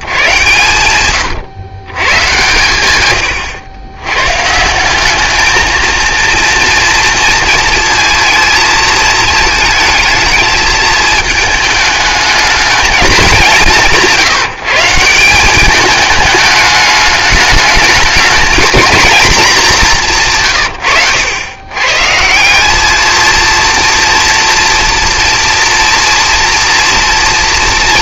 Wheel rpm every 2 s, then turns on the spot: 120, 130, 170, 230, 220, 220, 210, 170, 210, 230, 120, 210, 230, 230.
none